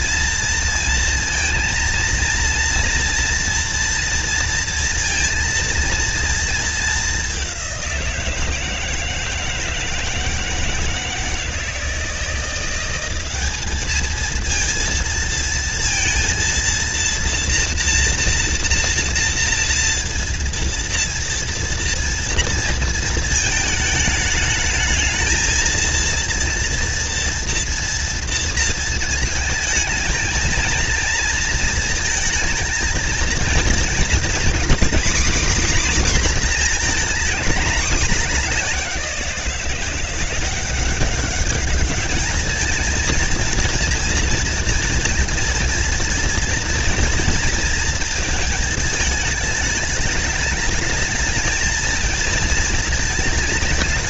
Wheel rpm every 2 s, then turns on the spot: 230, 240, 230, 210, 160, 160, 190, 230, 230, 230, 230, 230, 220, 240, 230, 230, 230, 250, 220, 180, 190, 230, 230, 230, 210, 220, 220.
none